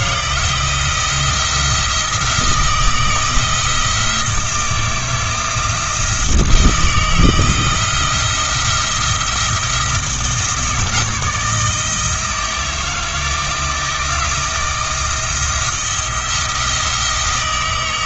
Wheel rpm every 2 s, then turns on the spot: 170, 170, 160, 170, 170, 160, 160, 170, 160.
none